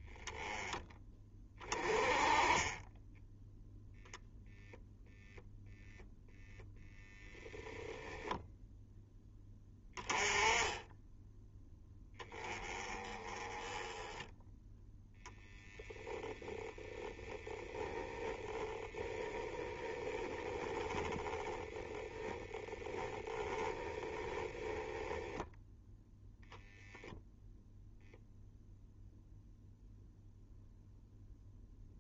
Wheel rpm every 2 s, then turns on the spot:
10, 10, 0, 0, 0, 10, 20, 0, 10, 10, 10, 10, 20, 0, 0, 0.
16-22 24-26